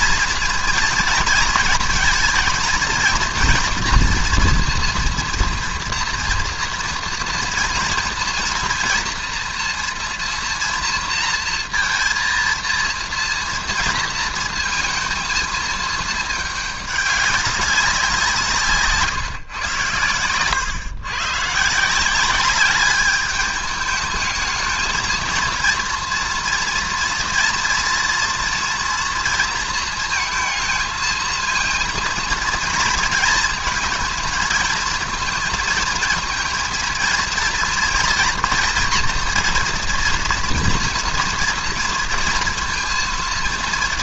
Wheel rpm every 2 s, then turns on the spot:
230, 230, 240, 240, 230, 230, 230, 220, 210, 160, 120, 200, 220, 230, 240, 220, 230, 220, 230, 230, 230, 230.
none